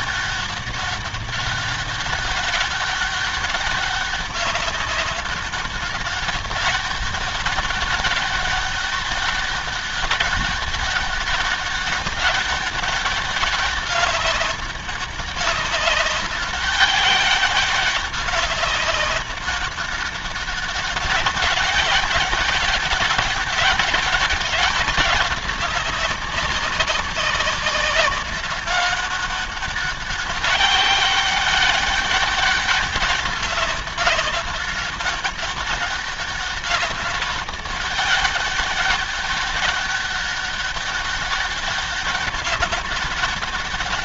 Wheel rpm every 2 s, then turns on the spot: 200, 200, 190, 200, 200, 200, 200, 200, 200, 200, 200, 200, 190, 190, 190, 200, 200, 190, 200, 200, 200, 200.
none